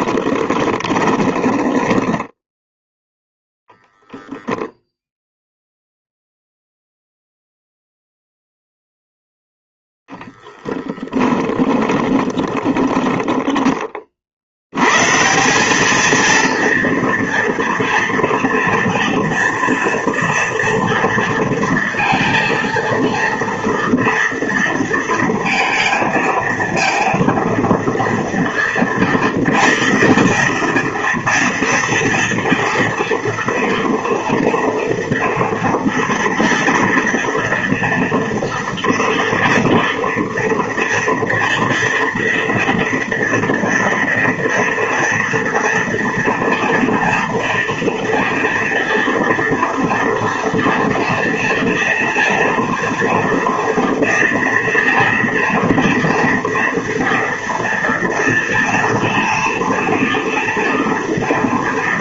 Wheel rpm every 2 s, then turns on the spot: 20, 10, 0, 0, 0, 10, 10, 80, 230, 230, 230, 230, 230, 220, 230, 230, 230, 230, 230, 240, 240, 230, 230, 230, 230, 230, 240, 230, 230, 230, 230.
0-4 12-14